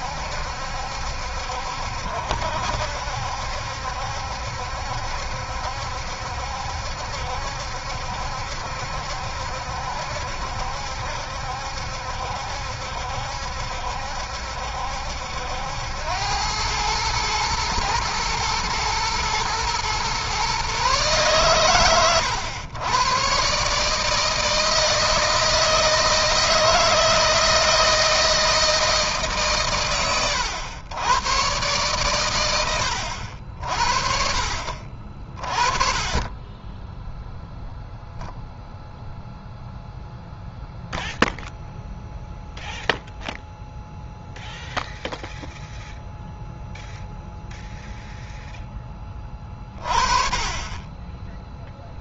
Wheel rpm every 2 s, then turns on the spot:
70, 70, 70, 70, 70, 70, 70, 70, 110, 110, 140, 120, 160, 160, 160, 110, 80, 50, 10, 0, 0, 0, 0, 0, 10, 20.
50-52